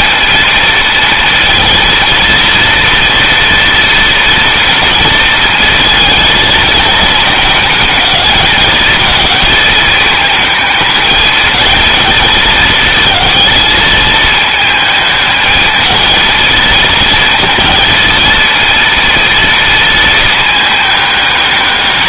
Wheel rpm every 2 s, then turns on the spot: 230, 230, 230, 230, 220, 220, 220, 220, 230, 230, 210.
none